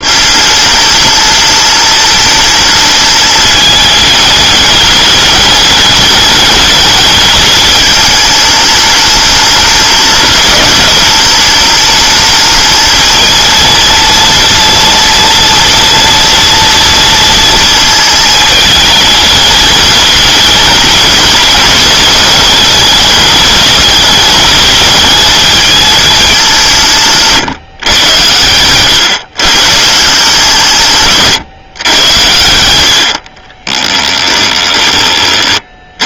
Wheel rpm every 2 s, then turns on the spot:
210, 210, 210, 210, 210, 210, 230, 230, 230, 220, 210, 210, 220, 150, 130, 150, 70, 30.
32-34